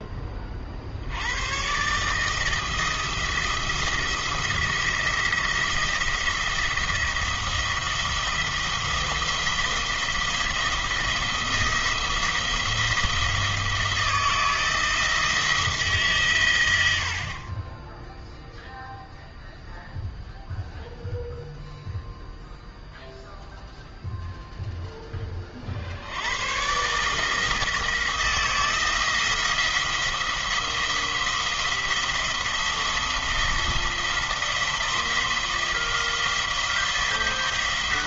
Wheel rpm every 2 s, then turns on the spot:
50, 160, 170, 170, 170, 170, 170, 160, 100, 0, 0, 0, 0, 120, 170, 170, 170, 170, 170.
none